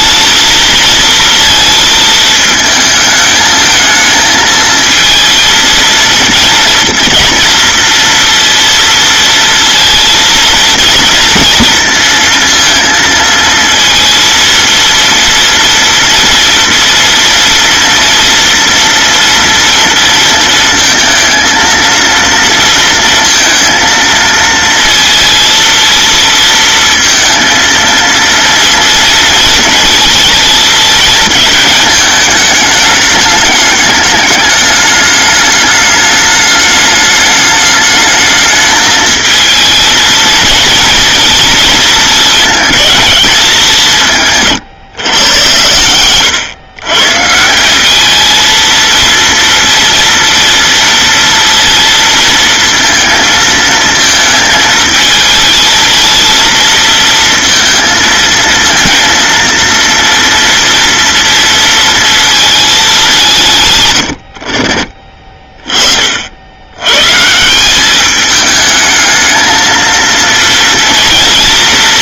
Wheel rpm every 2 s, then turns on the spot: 230, 220, 220, 230, 230, 230, 230, 230, 230, 230, 230, 230, 230, 230, 230, 220, 220, 210, 210, 220, 230, 220, 110, 120, 230, 230, 230, 220, 230, 230, 230, 210, 40, 90, 210, 230.
none